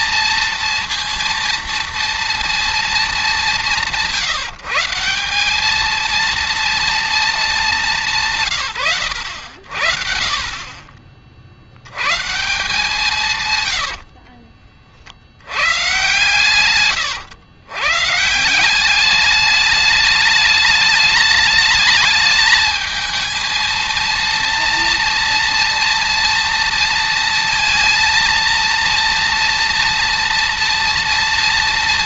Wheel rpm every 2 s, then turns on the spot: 230, 230, 170, 230, 140, 40, 150, 40, 120, 180, 210, 220, 230, 230, 230, 230.
none